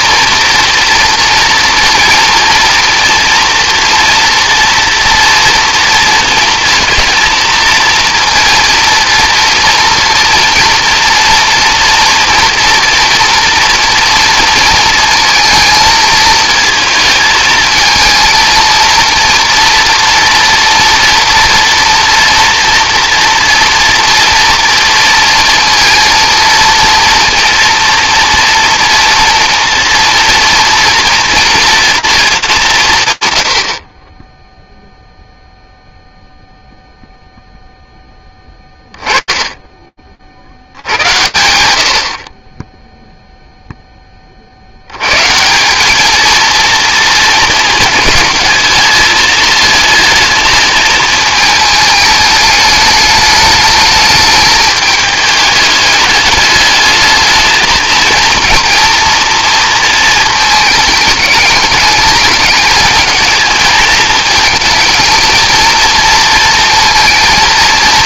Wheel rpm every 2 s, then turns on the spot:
230, 240, 230, 230, 230, 230, 230, 230, 220, 220, 230, 230, 230, 230, 230, 230, 200, 0, 0, 10, 120, 0, 110, 230, 210, 220, 210, 210, 220, 230, 210, 220, 220, 230.
none